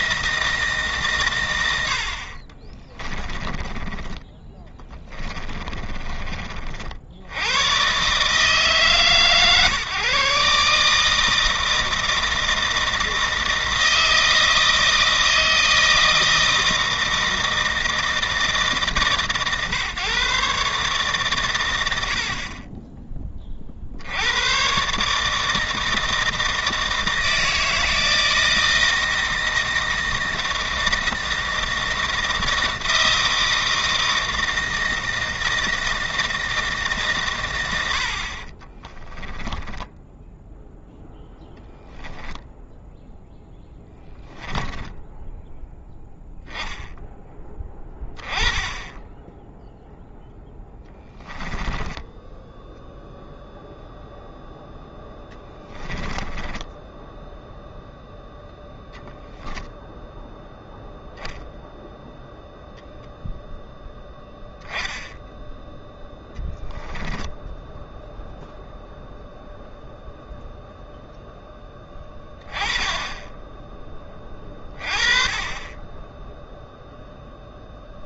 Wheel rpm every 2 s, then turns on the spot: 140, 30, 20, 60, 140, 150, 160, 160, 160, 150, 140, 20, 140, 160, 160, 160, 160, 160, 150, 20, 0, 0, 10, 0, 10, 10, 0, 0, 10, 0, 0, 0, 0, 10, 0, 0, 10, 20, 0.
2-6 38-40 44-46 56-58